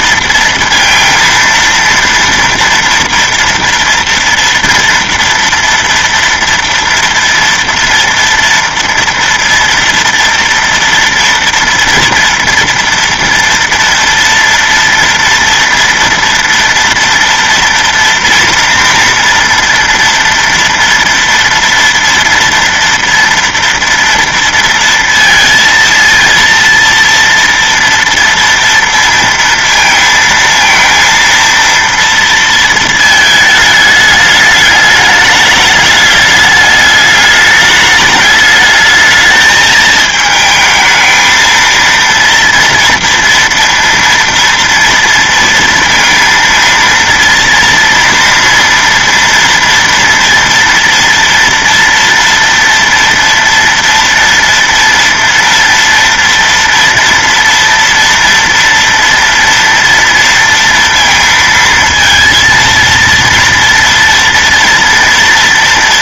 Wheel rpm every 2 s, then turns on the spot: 230, 230, 230, 230, 230, 230, 230, 230, 230, 240, 230, 230, 230, 230, 230, 230, 230, 210, 210, 210, 220, 230, 230, 230, 230, 230, 230, 230, 230, 230, 230, 230, 240.
none